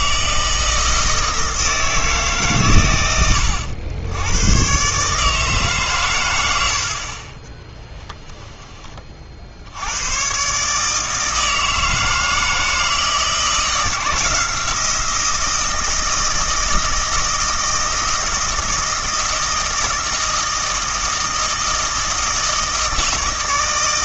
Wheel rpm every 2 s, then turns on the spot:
170, 120, 130, 80, 20, 140, 160, 170, 160, 160, 160, 160.
none